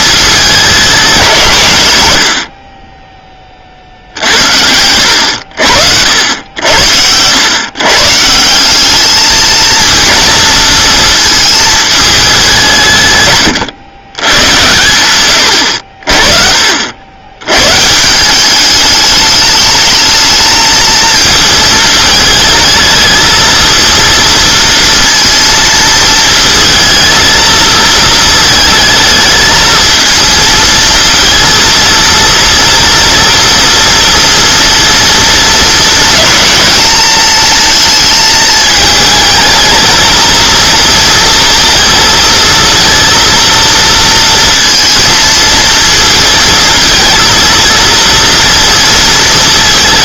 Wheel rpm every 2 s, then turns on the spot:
190, 30, 70, 80, 190, 220, 160, 110, 50, 200, 220, 220, 230, 220, 220, 230, 230, 230, 210, 220, 230, 230, 230, 230, 230.
none